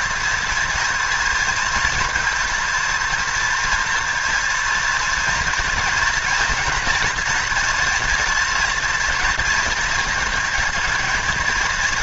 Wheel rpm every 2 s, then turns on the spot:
230, 230, 230, 240, 230, 220.
none